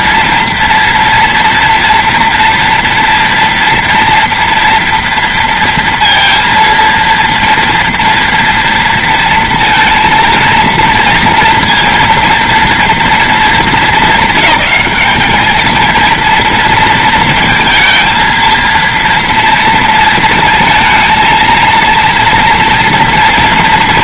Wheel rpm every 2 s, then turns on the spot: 230, 230, 240, 230, 230, 230, 230, 200, 230, 230, 230, 240.
none